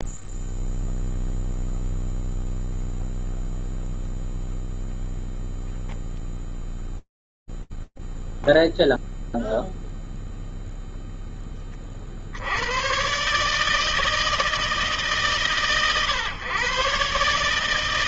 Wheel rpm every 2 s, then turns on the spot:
0, 0, 0, 0, 0, 0, 90, 150, 130.
none